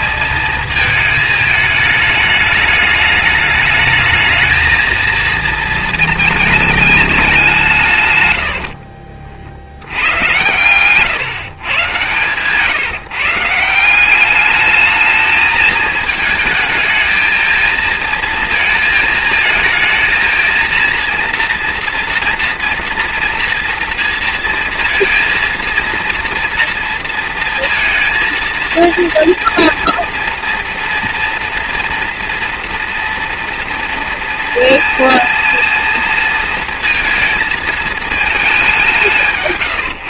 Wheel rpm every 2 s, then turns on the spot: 220, 210, 230, 200, 50, 130, 160, 220, 220, 220, 230, 230, 230, 230, 230, 230, 230, 230, 220, 170.
none